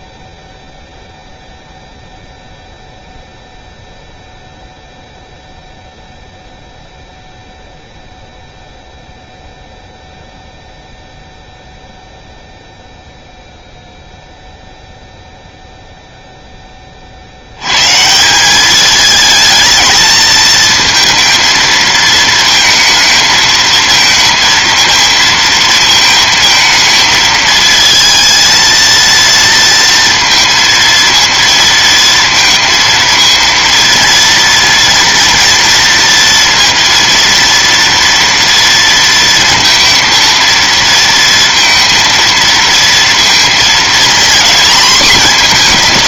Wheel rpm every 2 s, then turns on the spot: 0, 0, 0, 0, 0, 0, 0, 0, 50, 210, 230, 220, 230, 220, 230, 230, 230, 230, 230, 230, 230, 230, 240.
none